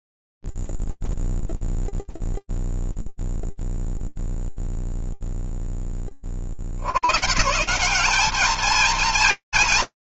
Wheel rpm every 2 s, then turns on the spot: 0, 0, 0, 50, 200.
none